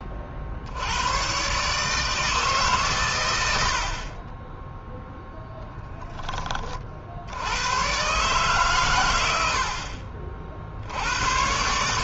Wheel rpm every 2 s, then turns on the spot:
60, 150, 10, 30, 140, 60.
none